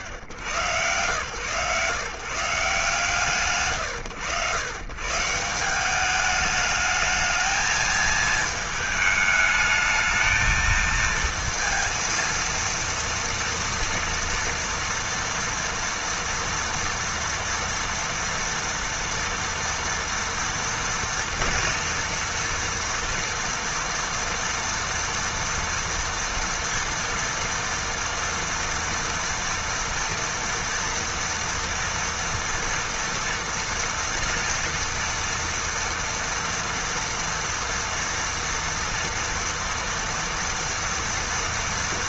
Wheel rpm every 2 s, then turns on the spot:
130, 110, 160, 220, 220, 230, 230, 230, 230, 230, 230, 230, 230, 230, 230, 230, 230, 230, 230, 230, 230.
none